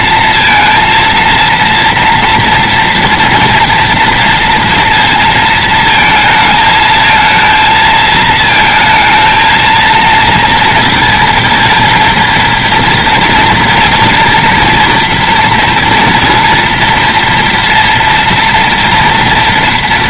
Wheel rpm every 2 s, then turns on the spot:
230, 230, 230, 230, 220, 230, 230, 230, 230, 230.
none